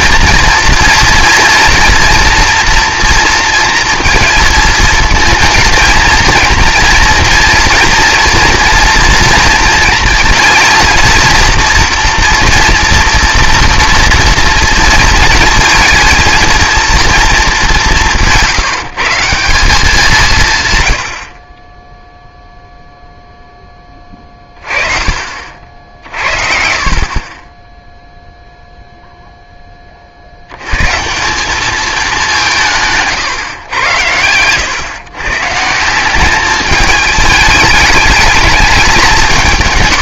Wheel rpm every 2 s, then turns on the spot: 230, 230, 230, 240, 240, 230, 240, 230, 230, 160, 140, 0, 30, 50, 0, 110, 170, 110, 210, 200.
none